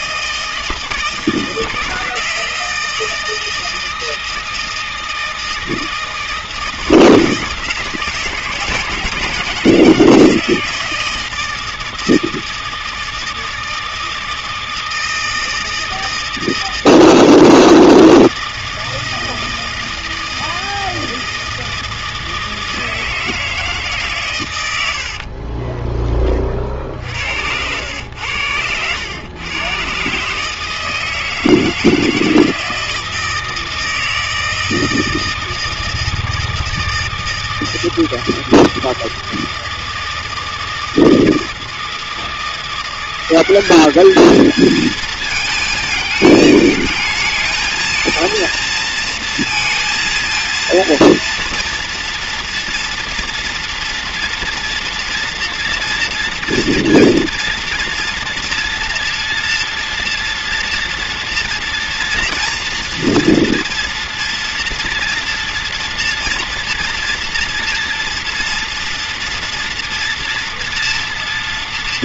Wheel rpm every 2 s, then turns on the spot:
160, 160, 160, 160, 160, 170, 160, 160, 160, 160, 160, 160, 80, 60, 100, 160, 160, 160, 160, 160, 160, 170, 220, 210, 230, 230, 230, 230, 230, 230, 230, 230, 230, 230, 230, 240.
24-26